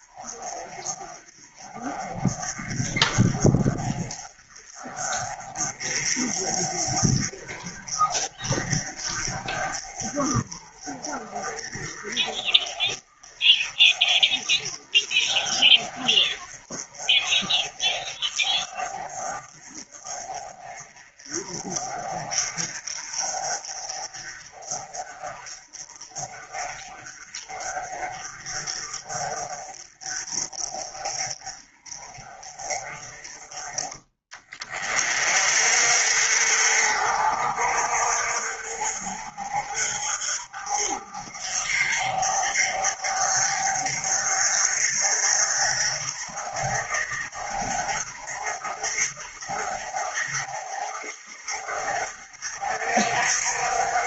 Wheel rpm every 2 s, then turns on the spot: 30, 30, 40, 40, 40, 40, 40, 30, 30, 30, 30, 40, 40, 40, 40, 40, 30, 40, 60, 50, 50, 50, 50, 50, 50, 50, 60.
none